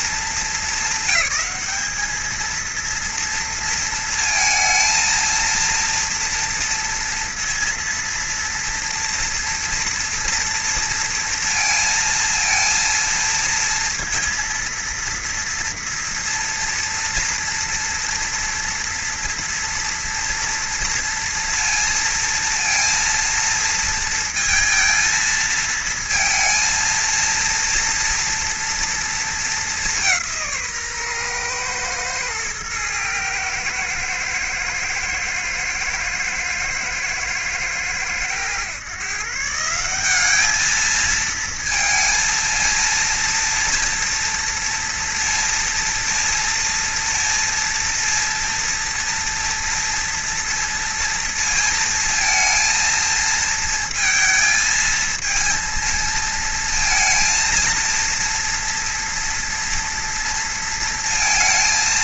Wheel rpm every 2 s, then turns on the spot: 220, 230, 220, 230, 230, 230, 230, 230, 230, 230, 230, 230, 230, 230, 230, 150, 110, 110, 110, 120, 220, 230, 230, 230, 230, 230, 230, 230, 230, 230, 230.
none